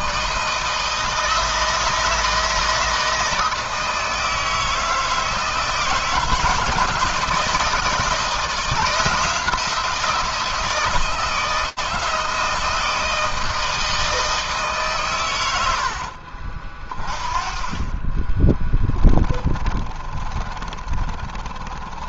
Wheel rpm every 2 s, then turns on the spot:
160, 160, 160, 160, 170, 170, 160, 140, 40, 20, 40.
18-22